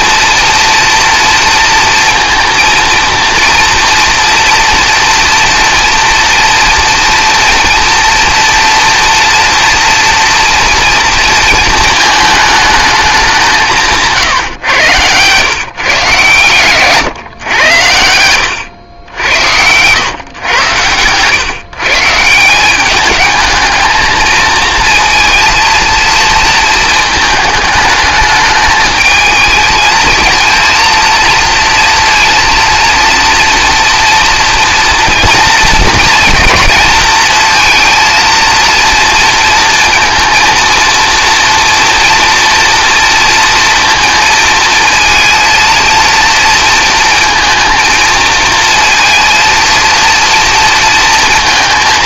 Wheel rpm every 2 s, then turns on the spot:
240, 230, 230, 240, 240, 230, 220, 120, 120, 100, 110, 190, 230, 220, 210, 230, 230, 230, 230, 230, 230, 230, 230, 230, 230, 230.
none